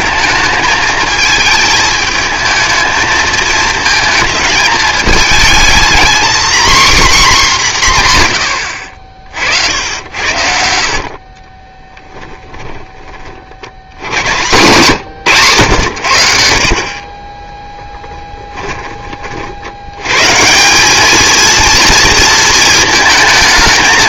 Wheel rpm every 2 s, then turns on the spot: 220, 220, 220, 270, 70, 60, 10, 140, 50, 20, 180, 230.
8-10